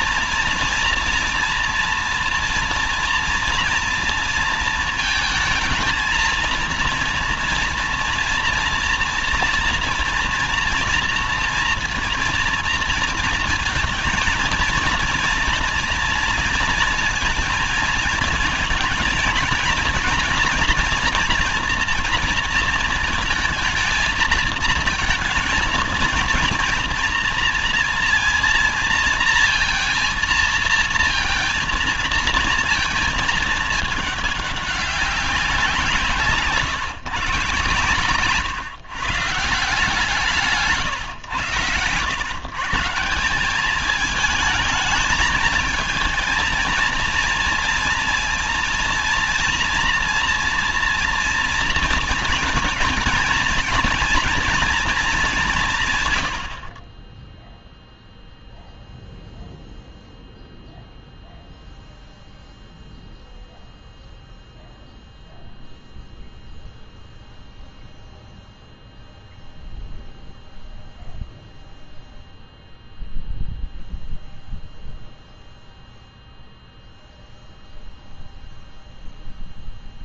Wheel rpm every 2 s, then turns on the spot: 230, 230, 230, 230, 240, 230, 230, 230, 230, 220, 230, 220, 230, 230, 230, 230, 230, 200, 140, 130, 160, 150, 220, 230, 230, 230, 230, 230, 50, 0, 0, 0, 0, 0, 0, 0, 0, 0, 0, 0.
none